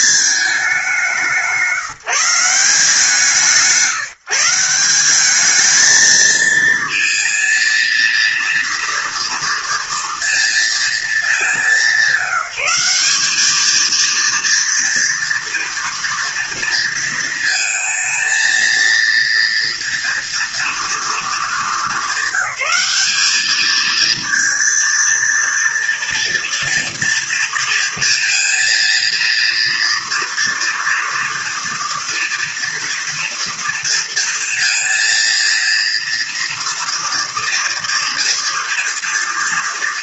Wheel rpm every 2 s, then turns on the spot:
210, 170, 170, 220, 230, 230, 190, 240, 230, 230, 230, 200, 230, 230, 230, 230, 230, 230, 230, 230.
none